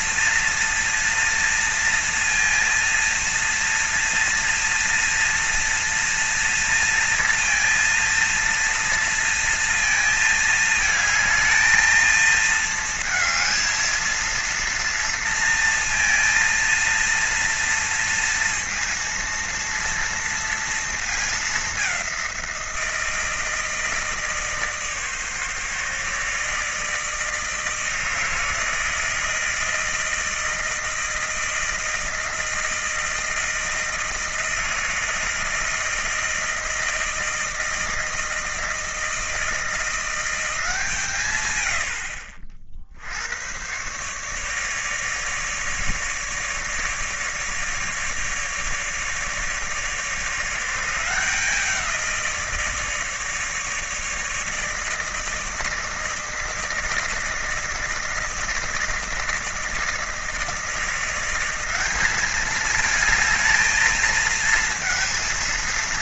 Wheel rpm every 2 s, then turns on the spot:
230, 230, 230, 230, 230, 220, 230, 230, 230, 230, 230, 170, 150, 160, 160, 160, 160, 160, 160, 160, 170, 60, 150, 150, 150, 170, 160, 160, 160, 160, 160, 210, 230.
none